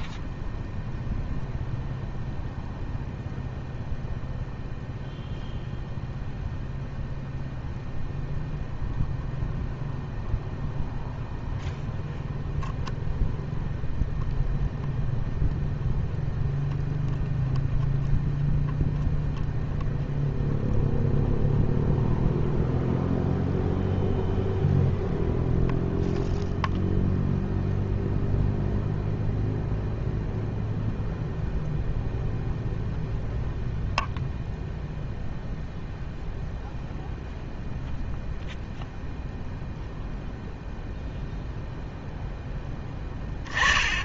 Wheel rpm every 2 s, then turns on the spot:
0, 0, 0, 0, 0, 0, 0, 0, 0, 0, 0, 0, 0, 0, 0, 0, 0, 0, 0, 0, 0, 10.
none